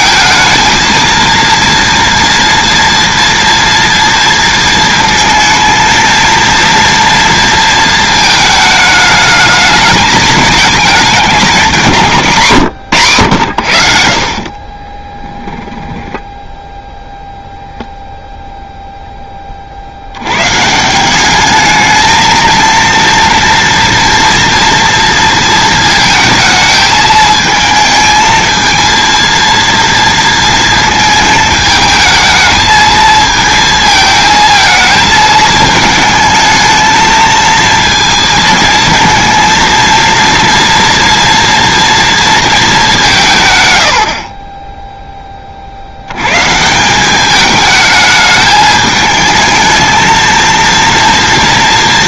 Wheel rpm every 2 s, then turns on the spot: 230, 230, 230, 230, 220, 210, 140, 40, 0, 0, 130, 230, 230, 220, 230, 230, 220, 220, 220, 230, 230, 220, 20, 160, 220, 230.
14-16